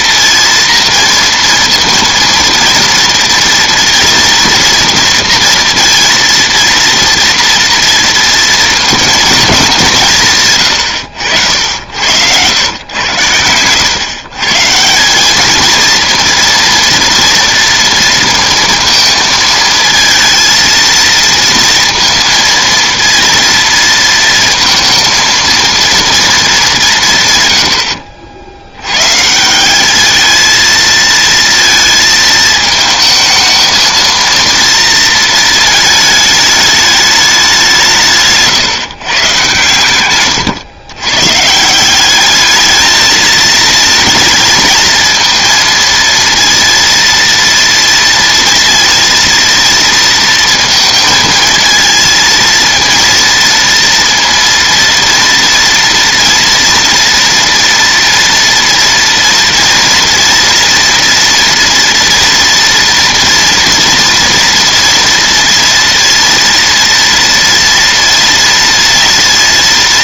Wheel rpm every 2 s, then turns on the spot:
230, 230, 230, 230, 230, 120, 100, 160, 230, 230, 230, 230, 230, 190, 80, 220, 220, 230, 210, 150, 120, 210, 230, 230, 230, 230, 230, 230, 230, 230, 230, 230, 230, 230, 230.
none